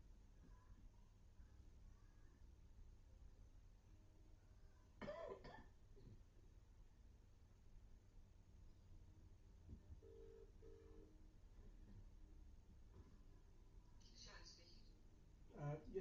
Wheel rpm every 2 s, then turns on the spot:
0, 0, 0, 0, 0, 0, 0, 0.
none